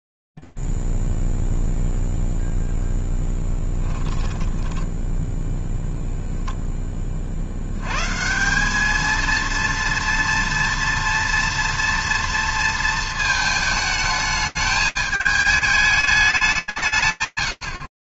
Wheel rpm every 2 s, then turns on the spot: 0, 0, 20, 10, 190, 240, 230, 220, 180.
4-6